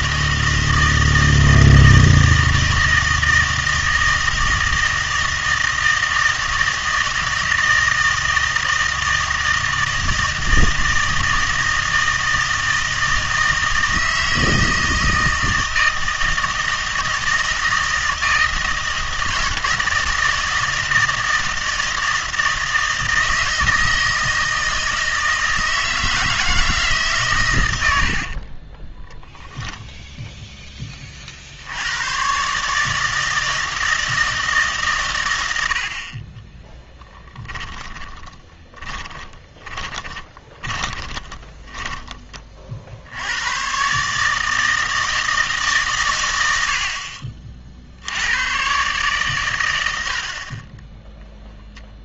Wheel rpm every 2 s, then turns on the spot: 160, 160, 160, 160, 160, 160, 160, 160, 160, 160, 160, 160, 160, 160, 20, 10, 150, 140, 10, 30, 20, 50, 160, 70, 120, 30.
28-30 36-42